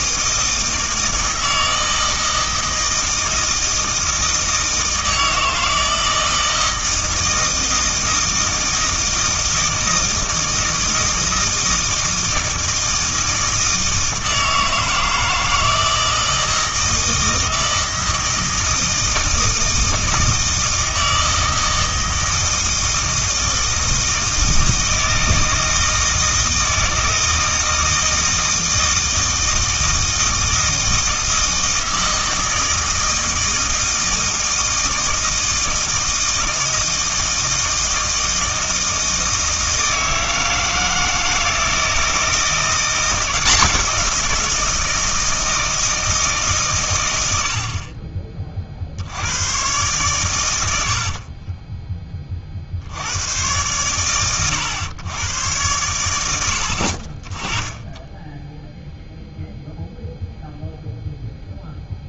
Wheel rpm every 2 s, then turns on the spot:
160, 160, 160, 160, 160, 160, 160, 160, 160, 160, 160, 160, 160, 160, 160, 160, 160, 160, 160, 160, 160, 170, 170, 130, 50, 70, 60, 110, 70, 0, 0.
none